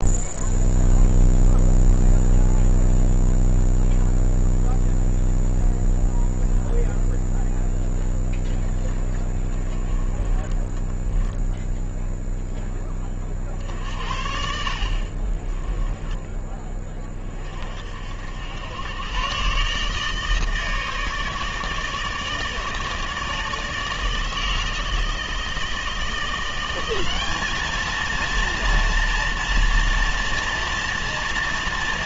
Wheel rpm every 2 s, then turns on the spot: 0, 0, 0, 0, 0, 20, 0, 60, 10, 70, 150, 160, 160, 170, 230, 230.
none